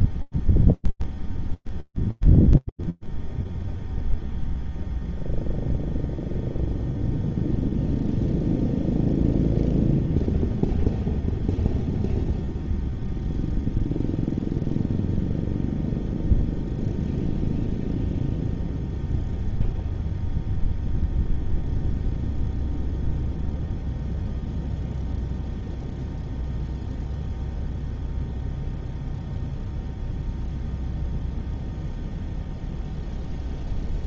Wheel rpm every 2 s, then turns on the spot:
0, 0, 0, 0, 0, 0, 0, 0, 0, 0, 0, 0, 0, 0, 0, 0, 0.
none